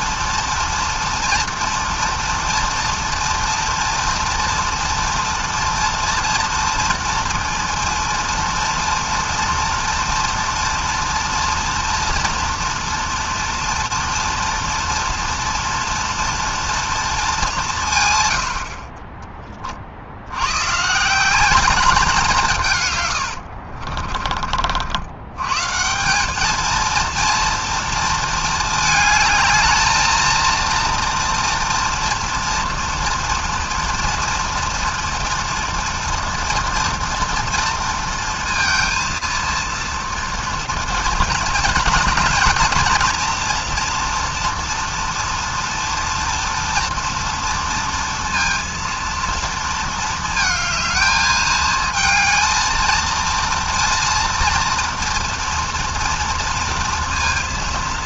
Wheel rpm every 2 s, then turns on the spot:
230, 230, 230, 230, 230, 230, 230, 230, 230, 90, 110, 170, 50, 210, 220, 230, 240, 230, 230, 230, 240, 240, 230, 230, 230, 230, 220, 230, 230.
none